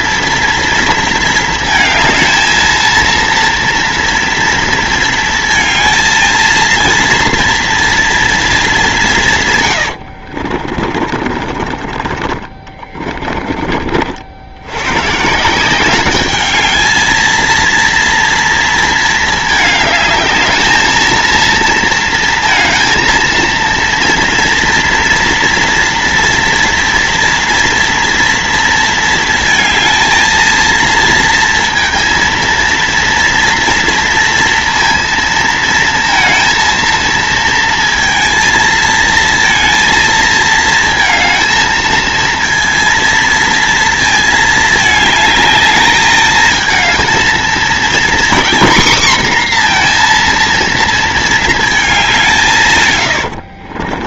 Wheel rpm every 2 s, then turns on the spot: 230, 230, 230, 230, 200, 50, 30, 100, 210, 230, 220, 230, 230, 240, 220, 230, 230, 230, 230, 230, 220, 230, 220, 220, 250, 230, 160.
10-14 52-54